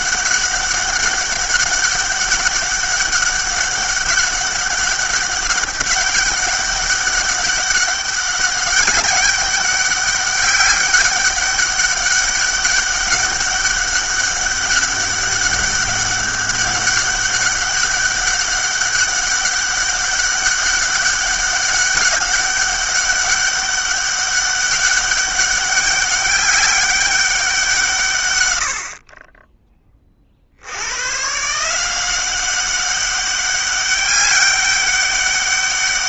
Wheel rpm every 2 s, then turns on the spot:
200, 200, 200, 200, 200, 200, 200, 200, 200, 200, 200, 200, 200, 200, 90, 70, 190, 200.
none